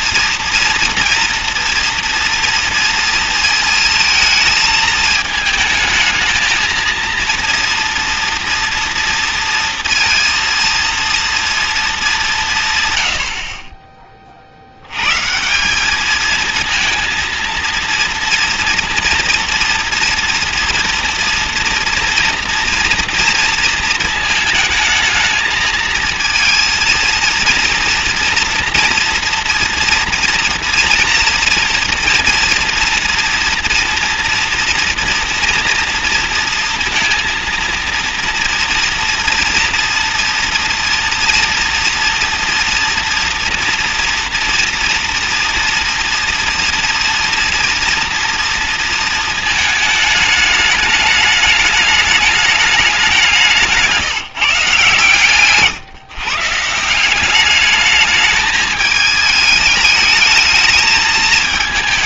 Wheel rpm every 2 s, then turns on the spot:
230, 230, 220, 230, 230, 230, 140, 70, 220, 230, 230, 230, 220, 230, 230, 230, 240, 230, 230, 230, 230, 230, 230, 230, 230, 210, 210, 150, 150, 220, 210.
none